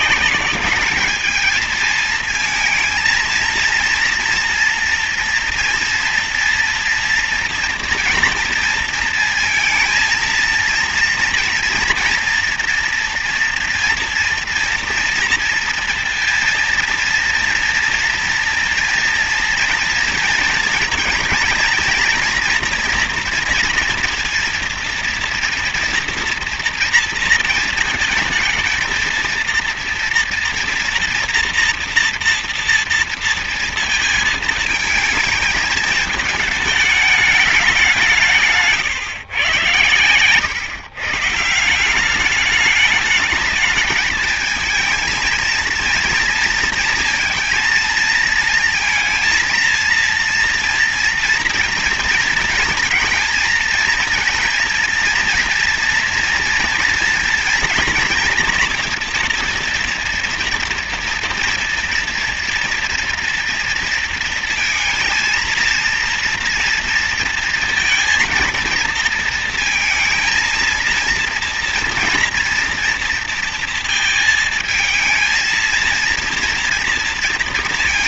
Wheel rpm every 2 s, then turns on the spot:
210, 230, 230, 230, 230, 230, 230, 230, 230, 230, 230, 230, 230, 230, 220, 240, 230, 220, 210, 140, 110, 210, 220, 230, 220, 230, 230, 230, 230, 230, 230, 230, 230, 230, 230, 230, 230, 220, 230.
none